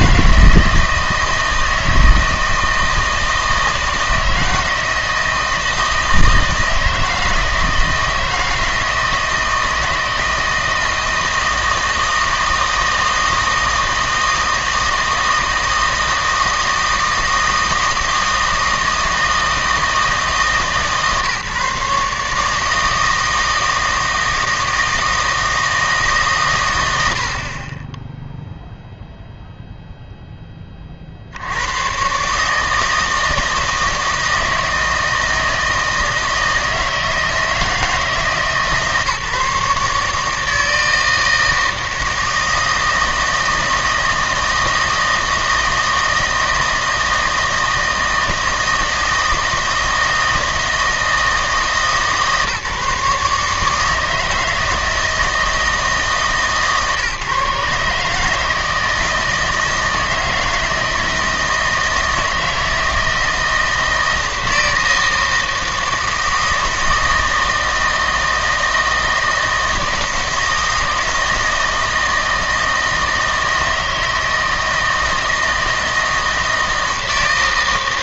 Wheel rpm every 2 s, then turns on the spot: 160, 160, 160, 160, 160, 160, 160, 160, 160, 160, 150, 160, 160, 110, 0, 20, 150, 160, 160, 150, 160, 160, 160, 160, 160, 160, 150, 160, 140, 160, 160, 160, 160, 160, 160, 160, 160, 160, 160.
none